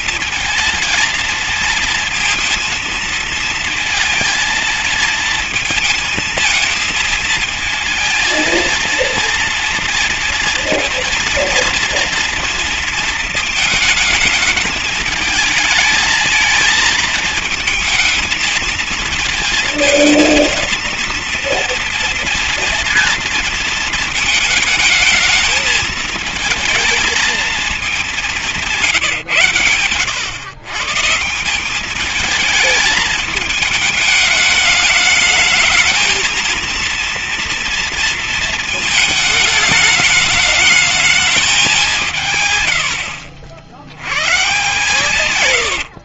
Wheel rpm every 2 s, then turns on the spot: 220, 230, 230, 230, 230, 230, 230, 220, 220, 230, 230, 230, 220, 220, 180, 130, 210, 210, 230, 220, 220, 100, 140.
none